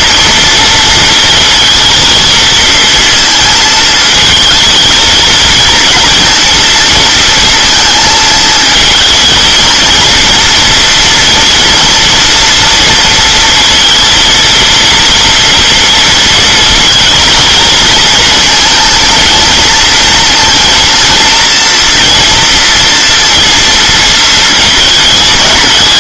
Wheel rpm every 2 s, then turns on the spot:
230, 230, 220, 230, 230, 230, 230, 230, 230, 230, 230, 240, 220.
none